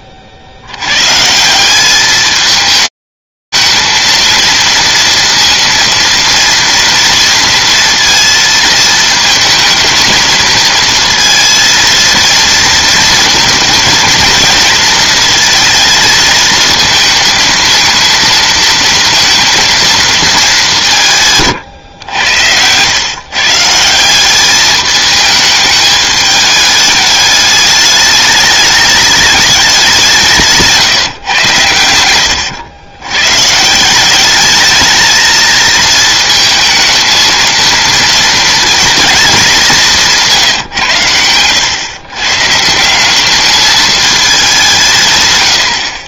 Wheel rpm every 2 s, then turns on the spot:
10, 200, 230, 230, 230, 220, 230, 220, 220, 230, 200, 110, 210, 210, 210, 150, 110, 210, 220, 230, 140, 160, 170.
none